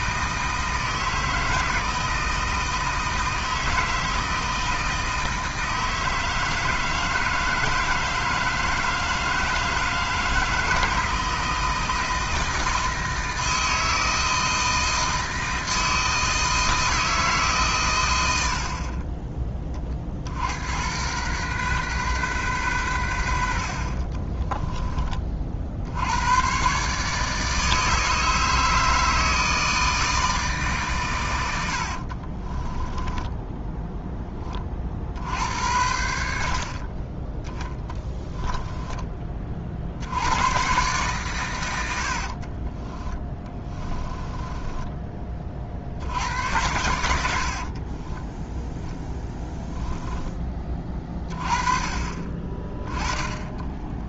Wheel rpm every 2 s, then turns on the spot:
160, 160, 160, 160, 160, 160, 160, 160, 160, 50, 90, 110, 20, 140, 160, 140, 10, 40, 40, 10, 120, 20, 20, 90, 10, 20, 20.
32-34 38-40 42-46